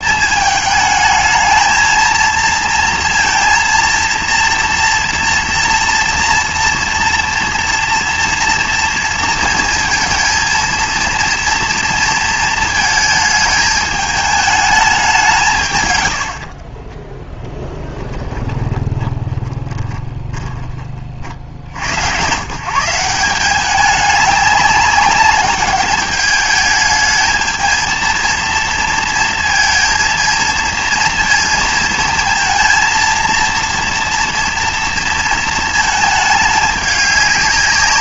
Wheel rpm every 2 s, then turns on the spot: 220, 230, 230, 230, 230, 230, 220, 210, 30, 20, 30, 160, 200, 210, 230, 230, 230, 230, 210.
16-20